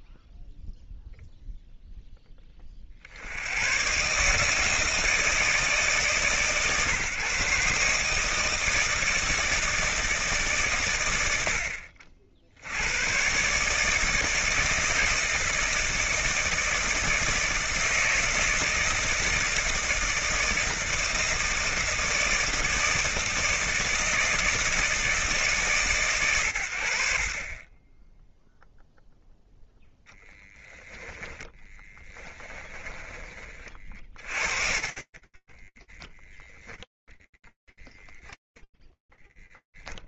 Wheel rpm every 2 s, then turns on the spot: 0, 40, 160, 140, 160, 110, 100, 160, 170, 160, 170, 160, 160, 100, 0, 10, 20, 40, 0, 10.
30-36 38-40